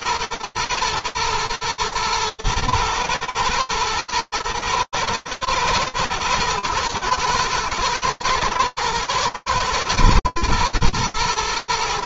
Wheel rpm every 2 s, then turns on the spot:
120, 110, 110, 120, 110, 110.
none